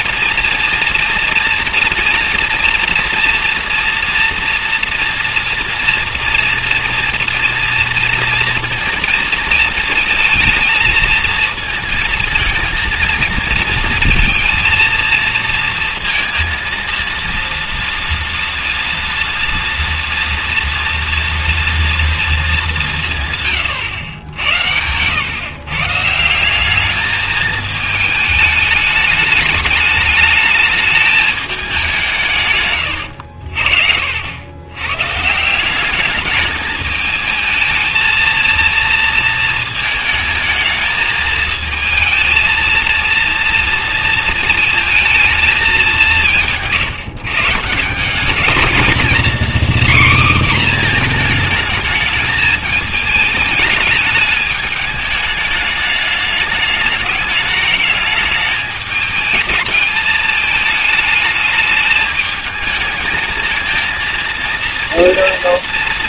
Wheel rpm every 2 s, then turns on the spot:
230, 230, 230, 230, 230, 220, 230, 230, 230, 230, 230, 200, 100, 200, 210, 210, 130, 100, 220, 230, 220, 230, 230, 150, 220, 250, 220, 210, 210, 210, 210, 220, 230.
none